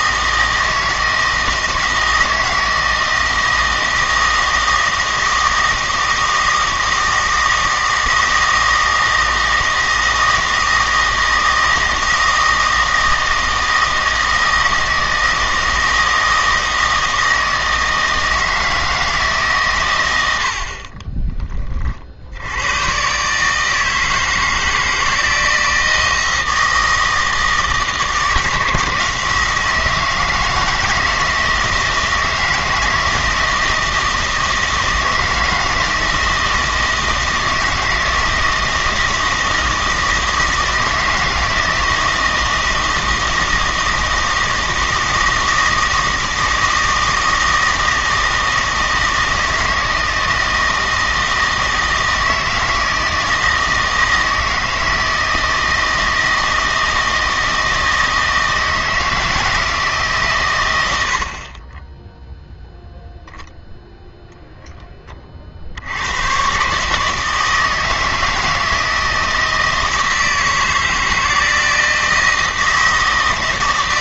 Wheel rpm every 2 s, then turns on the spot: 160, 160, 160, 160, 160, 160, 160, 160, 160, 160, 50, 110, 160, 170, 160, 160, 160, 160, 160, 160, 160, 160, 160, 160, 160, 160, 160, 160, 160, 160, 110, 0, 10, 140, 160, 160, 160.
none